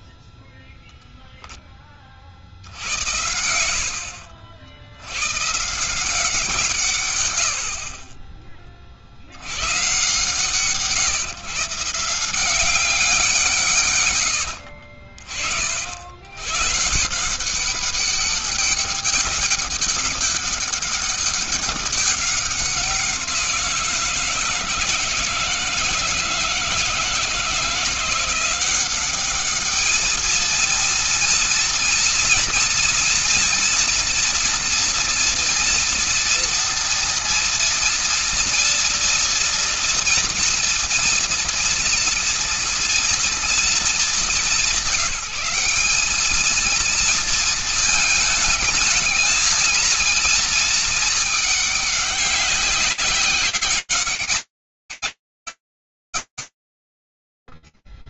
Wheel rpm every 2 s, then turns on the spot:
0, 70, 80, 180, 30, 140, 180, 70, 120, 200, 200, 190, 160, 160, 180, 220, 230, 230, 230, 230, 230, 230, 190, 220, 220, 220, 190, 200, 170.
2-4